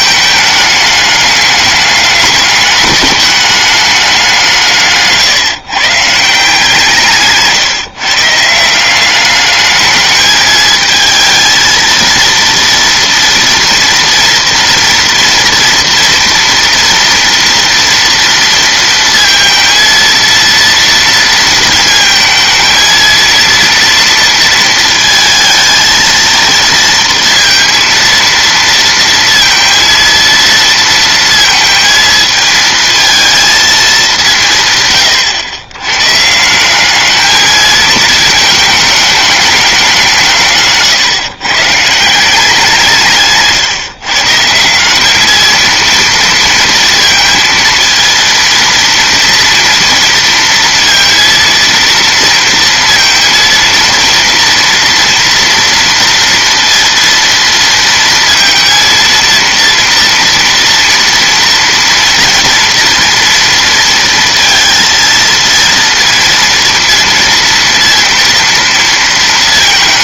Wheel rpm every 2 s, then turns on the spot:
210, 210, 150, 150, 180, 220, 230, 230, 240, 230, 230, 230, 230, 230, 230, 230, 220, 130, 210, 210, 130, 160, 200, 230, 230, 230, 230, 230, 230, 230, 240, 230, 230, 230, 230.
none